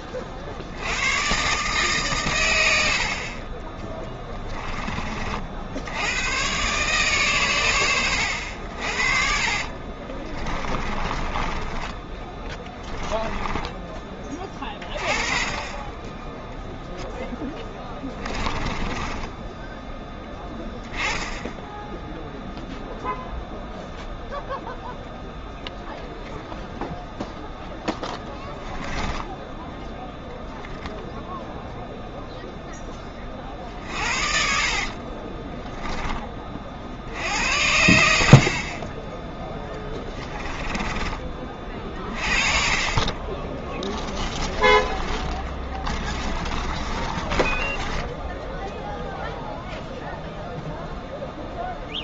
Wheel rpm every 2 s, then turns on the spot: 80, 80, 20, 130, 70, 30, 10, 20, 0, 20, 10, 0, 0, 0, 10, 0, 10, 40, 50, 40, 20, 40, 20, 20, 0, 0.
10-14 18-20 28-30 34-36 40-42 44-48